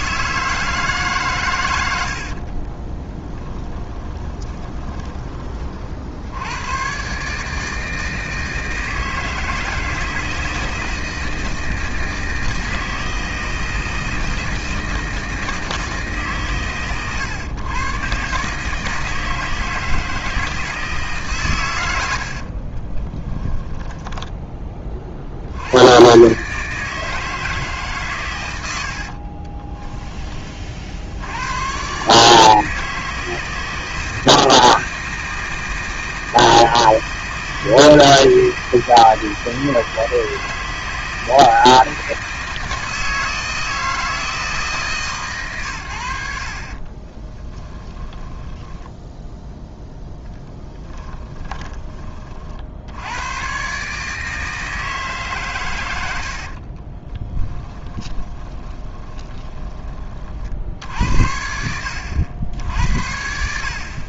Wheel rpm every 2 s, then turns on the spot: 150, 40, 20, 120, 160, 160, 160, 160, 130, 160, 150, 20, 30, 150, 70, 60, 160, 160, 160, 160, 160, 160, 150, 40, 10, 10, 80, 160, 30, 20, 60, 70.
2-6 22-24 28-30 46-52 56-60